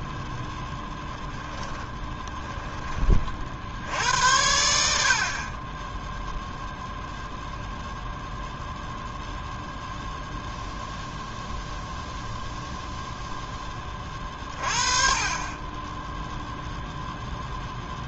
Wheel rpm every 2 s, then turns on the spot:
0, 20, 60, 0, 0, 0, 0, 30, 0.
none